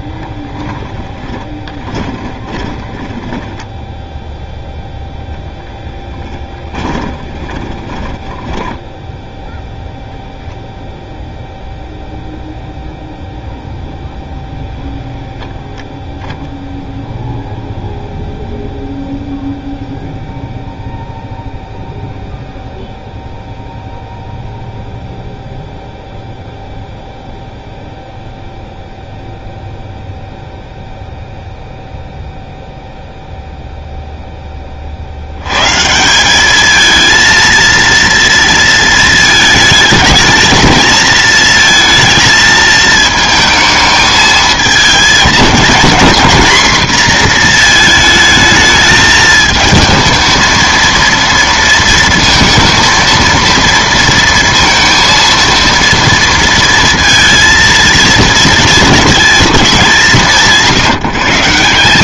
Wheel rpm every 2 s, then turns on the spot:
10, 20, 0, 20, 10, 0, 0, 0, 0, 0, 0, 0, 0, 0, 0, 0, 0, 30, 220, 230, 220, 220, 220, 240, 220, 230, 230, 230, 230, 230, 150.
0-4 6-10